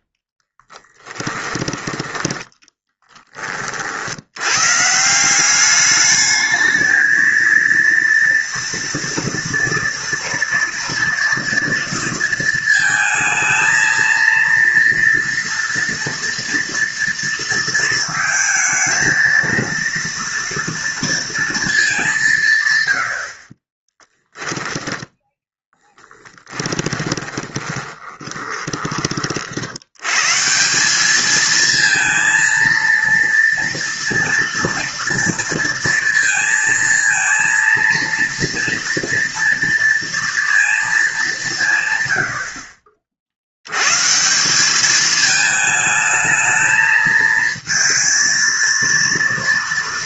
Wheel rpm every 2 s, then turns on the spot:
10, 10, 170, 230, 230, 230, 220, 230, 230, 220, 230, 90, 10, 10, 30, 190, 230, 230, 230, 230, 230, 70, 180, 220, 230.
0-2 24-28